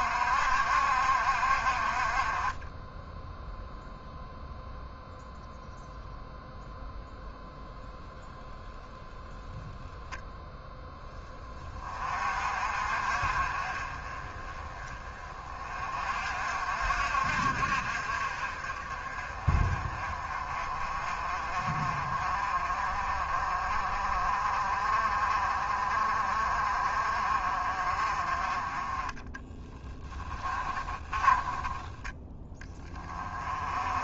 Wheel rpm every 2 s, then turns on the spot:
60, 10, 0, 0, 0, 20, 50, 30, 60, 40, 40, 40, 40, 40, 20, 20, 20.
30-32